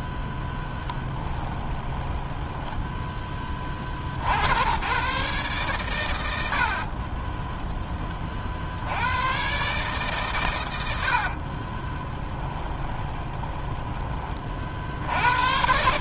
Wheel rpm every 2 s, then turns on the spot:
10, 10, 100, 70, 50, 110, 20, 40.
2-4 12-14